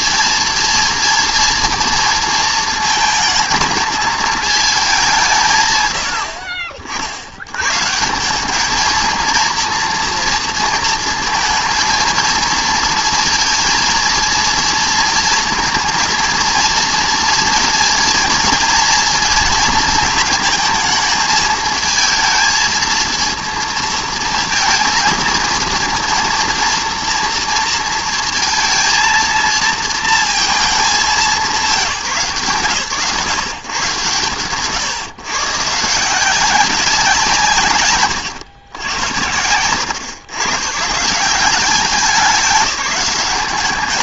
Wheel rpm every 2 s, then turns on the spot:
230, 230, 210, 60, 220, 230, 230, 230, 230, 230, 230, 230, 230, 230, 230, 210, 130, 110, 180, 90, 140, 190.
none